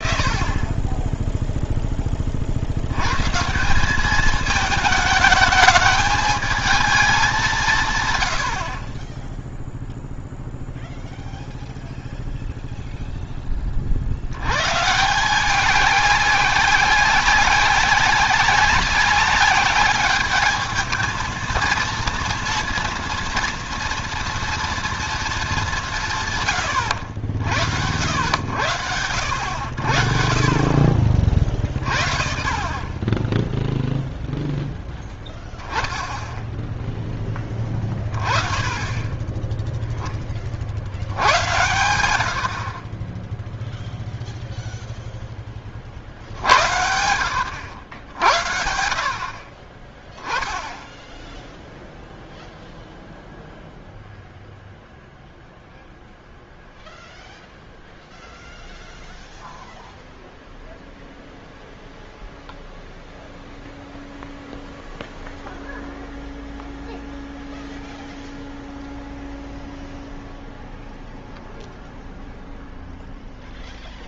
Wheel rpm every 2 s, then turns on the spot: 20, 80, 210, 220, 50, 0, 0, 130, 190, 190, 220, 230, 240, 110, 90, 50, 40, 0, 0, 20, 60, 50, 0, 80, 70, 0, 0, 0, 0, 0, 0, 0, 0, 0, 0, 0, 0.
none